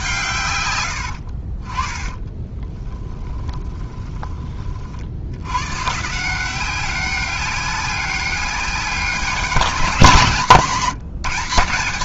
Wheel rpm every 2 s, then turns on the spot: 110, 10, 40, 180, 200, 170.
2-4